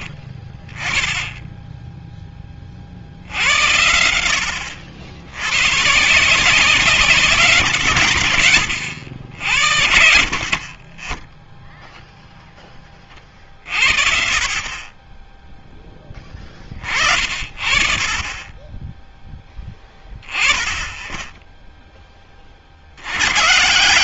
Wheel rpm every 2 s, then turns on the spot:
20, 60, 80, 150, 80, 20, 20, 20, 50, 10, 10, 60.
none